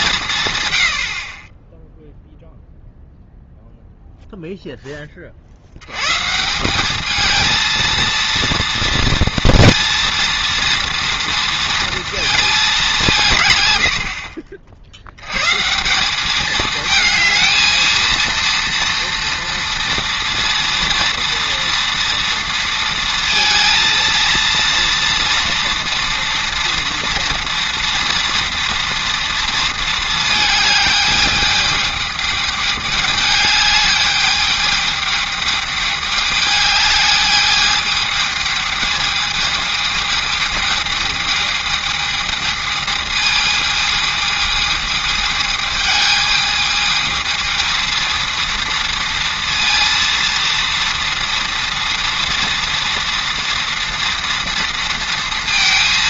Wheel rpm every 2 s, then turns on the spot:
130, 0, 0, 180, 230, 230, 210, 60, 210, 230, 230, 230, 230, 230, 230, 220, 210, 210, 210, 220, 220, 220, 220, 220, 230, 230, 230, 230.
none